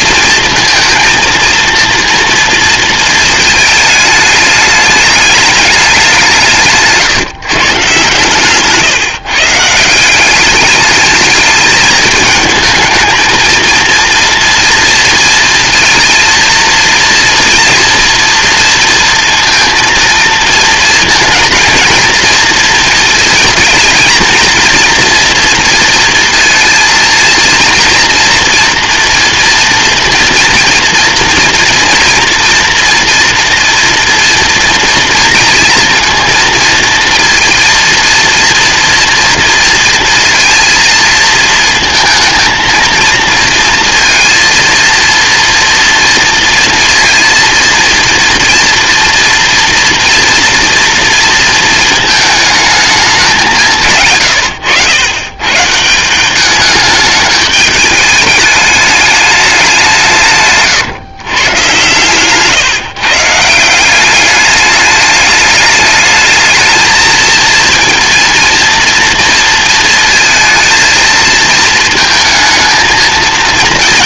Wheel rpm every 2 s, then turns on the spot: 230, 230, 210, 160, 140, 200, 220, 230, 230, 230, 230, 230, 240, 230, 230, 230, 240, 230, 230, 230, 230, 230, 230, 230, 230, 230, 220, 100, 200, 210, 140, 140, 210, 220, 230, 220, 230.
54-56 60-62